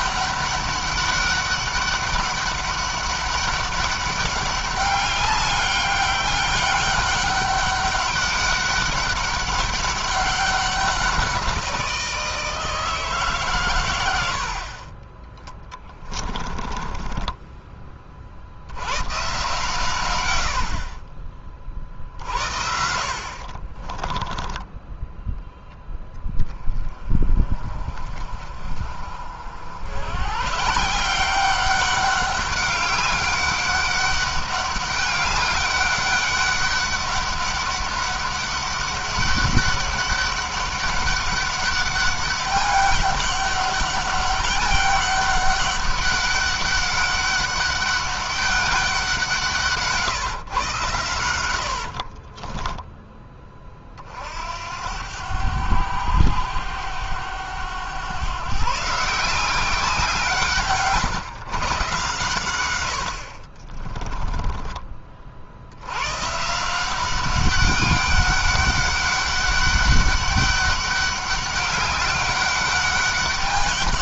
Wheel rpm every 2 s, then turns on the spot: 200, 200, 200, 200, 200, 190, 160, 30, 20, 90, 50, 60, 10, 30, 50, 160, 200, 200, 200, 200, 200, 200, 200, 200, 190, 120, 20, 80, 100, 150, 140, 90, 30, 170, 200, 200, 200.
16-18 20-24